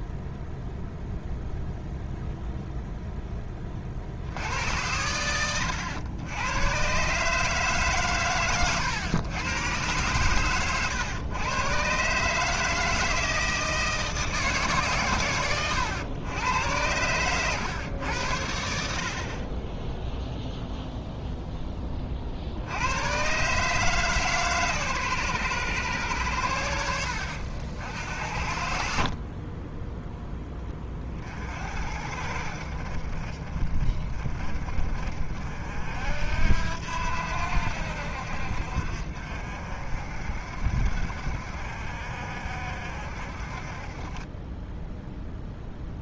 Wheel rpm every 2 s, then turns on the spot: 0, 0, 80, 120, 110, 110, 160, 150, 110, 80, 0, 80, 130, 80, 60, 20, 60, 40, 80, 60, 60, 60, 10.
none